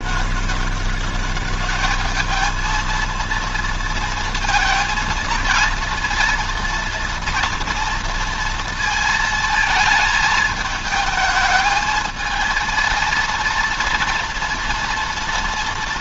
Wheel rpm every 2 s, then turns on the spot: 200, 220, 230, 240, 230, 220, 230, 230.
none